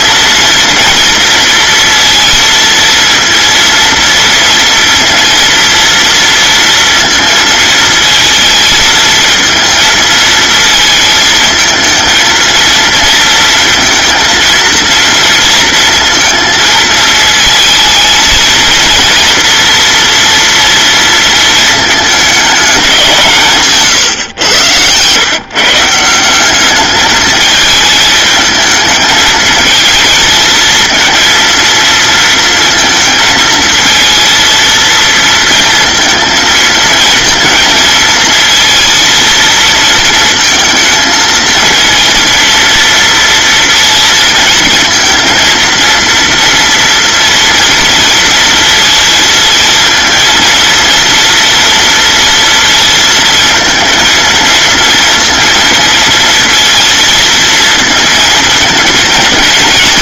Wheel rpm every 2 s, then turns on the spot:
230, 230, 230, 230, 230, 220, 230, 230, 230, 230, 230, 200, 110, 200, 220, 230, 230, 220, 230, 230, 220, 230, 230, 230, 230, 230, 230, 230, 230, 230.
none